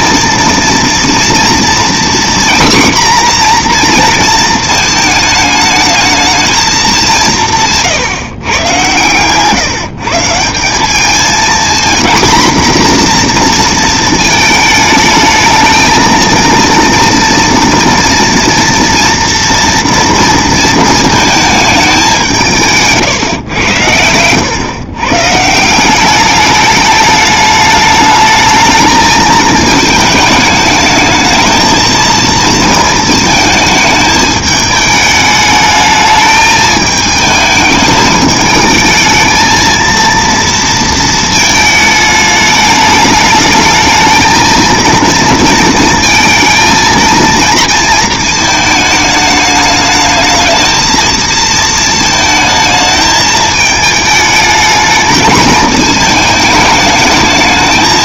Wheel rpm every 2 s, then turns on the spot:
230, 250, 220, 210, 120, 180, 240, 220, 230, 230, 230, 160, 120, 210, 220, 210, 220, 210, 220, 220, 230, 210, 230, 230, 220, 220, 220, 210, 220.
none